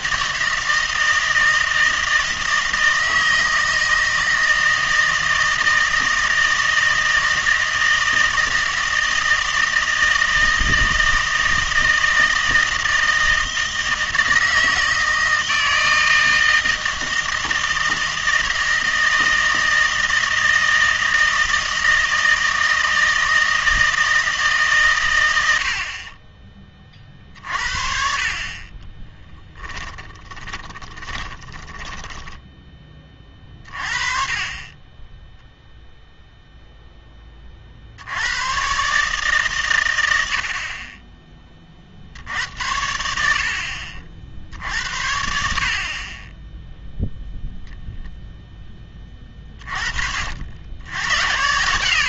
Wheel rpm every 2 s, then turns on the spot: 160, 160, 160, 160, 160, 160, 160, 160, 160, 160, 160, 160, 140, 30, 30, 20, 20, 20, 0, 120, 50, 70, 60, 0, 10, 80.
30-32